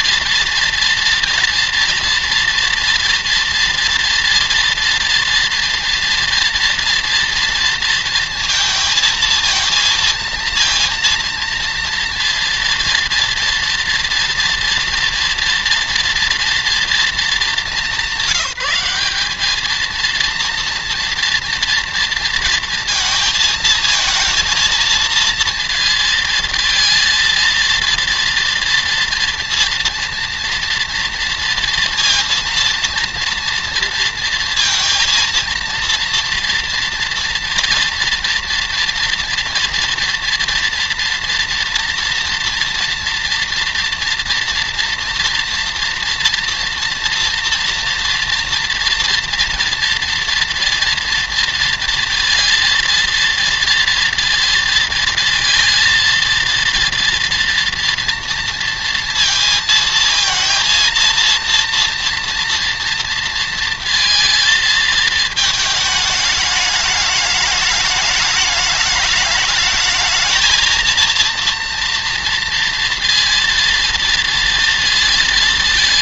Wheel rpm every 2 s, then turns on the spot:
230, 230, 230, 230, 230, 230, 240, 240, 230, 190, 230, 230, 230, 230, 230, 240, 230, 230, 240, 230, 230, 230, 230, 240, 230, 230, 230, 230, 230, 230, 230, 230, 230, 210, 210, 220, 230, 230.
none